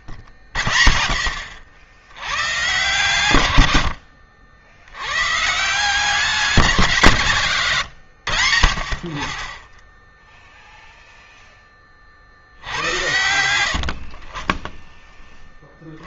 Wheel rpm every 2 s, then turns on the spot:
50, 110, 90, 170, 80, 0, 60, 30.
none